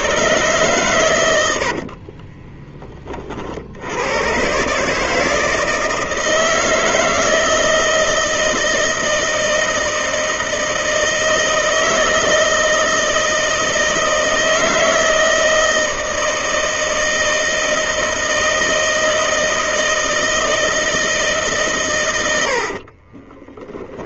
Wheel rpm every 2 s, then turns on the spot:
110, 20, 140, 160, 160, 160, 160, 160, 160, 160, 160, 40.
22-24